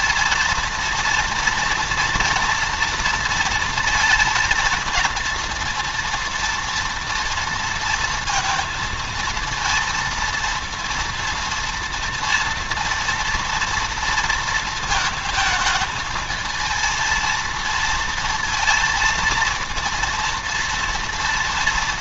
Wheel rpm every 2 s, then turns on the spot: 230, 230, 230, 230, 230, 230, 230, 230, 220, 230, 230.
none